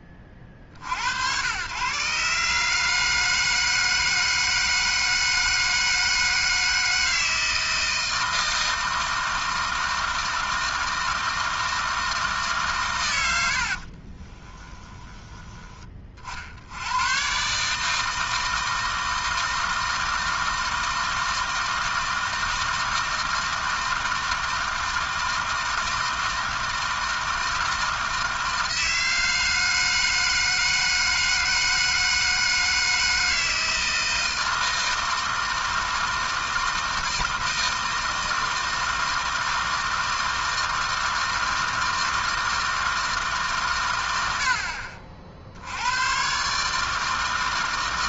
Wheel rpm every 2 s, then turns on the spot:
60, 140, 160, 160, 160, 160, 140, 20, 80, 160, 160, 160, 160, 160, 160, 160, 160, 160, 160, 160, 160, 160, 40, 150.
14-16